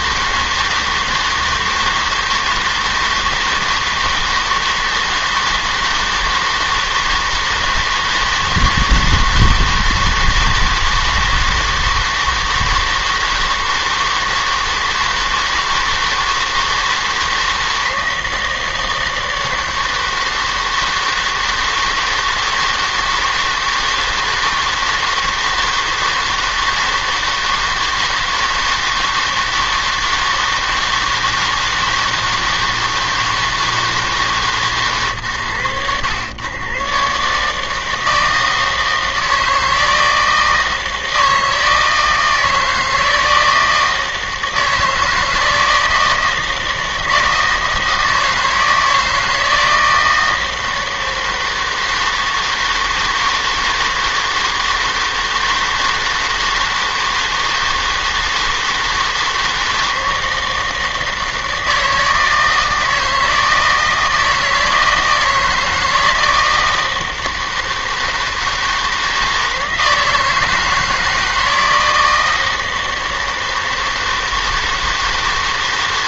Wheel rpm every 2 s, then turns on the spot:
160, 160, 160, 160, 160, 160, 160, 160, 160, 170, 160, 160, 160, 160, 160, 160, 160, 140, 120, 160, 160, 160, 160, 160, 160, 160, 160, 160, 160, 160, 160, 160, 160, 160, 160, 160, 160, 160.
none